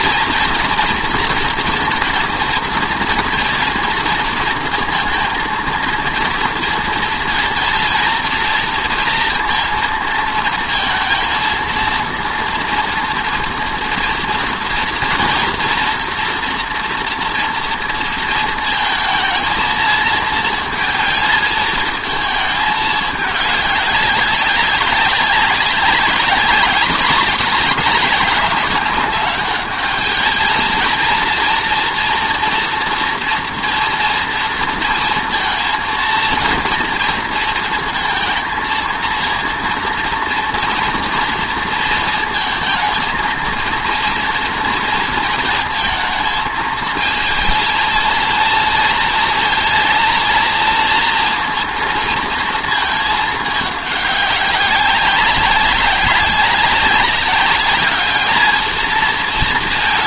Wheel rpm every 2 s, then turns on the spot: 230, 230, 230, 230, 230, 230, 230, 230, 230, 230, 230, 220, 200, 200, 210, 220, 230, 230, 230, 230, 230, 220, 230, 220, 230, 230, 220, 200, 190, 220.
none